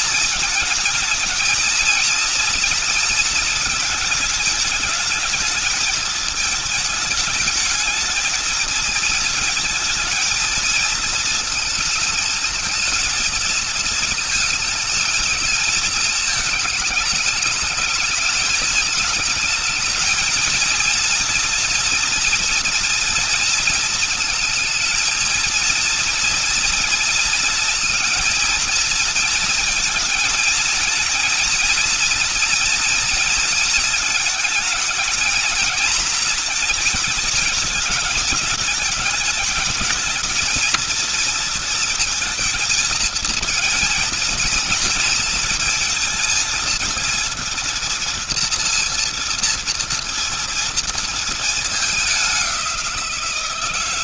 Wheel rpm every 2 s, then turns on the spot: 230, 230, 220, 220, 220, 230, 220, 220, 220, 220, 220, 240, 220, 230, 230, 220, 230, 220, 230, 210, 220, 230, 230, 230, 230, 230, 200.
none